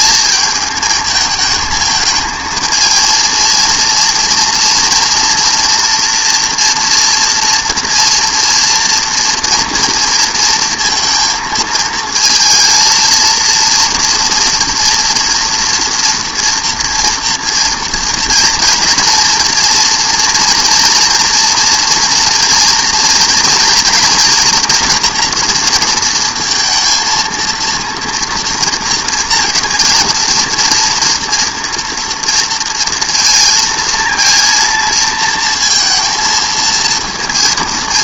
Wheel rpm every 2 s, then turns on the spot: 220, 220, 230, 240, 230, 230, 220, 240, 230, 230, 230, 230, 230, 230, 230, 230, 230, 230, 230.
none